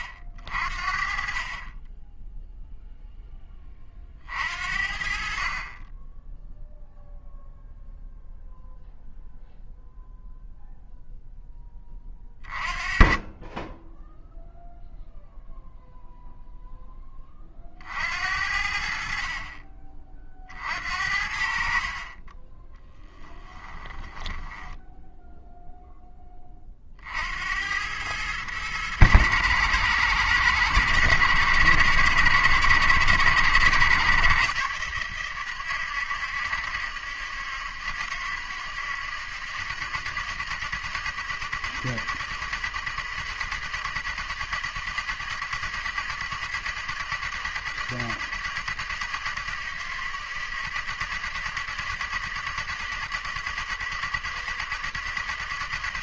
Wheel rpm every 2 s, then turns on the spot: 50, 0, 50, 0, 0, 0, 30, 0, 0, 70, 50, 10, 10, 30, 110, 110, 110, 120, 120, 120, 120, 110, 120, 120, 120, 120, 120, 120.
22-26